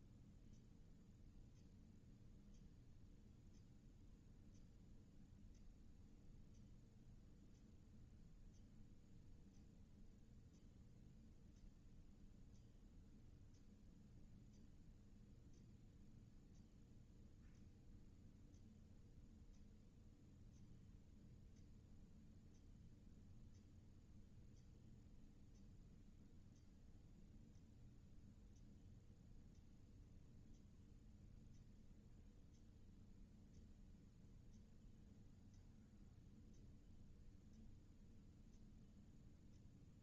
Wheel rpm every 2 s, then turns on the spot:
0, 0, 0, 0, 0, 0, 0, 0, 0, 0, 0, 0, 0, 0, 0, 0, 0, 0, 0, 0.
none